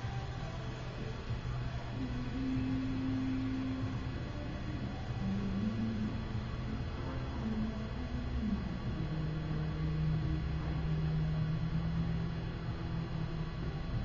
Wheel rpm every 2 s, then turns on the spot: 0, 0, 0, 0, 0, 0, 0.
none